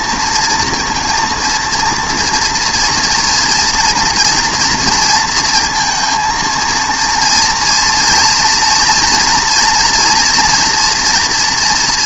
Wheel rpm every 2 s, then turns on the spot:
230, 230, 230, 230, 240, 240.
none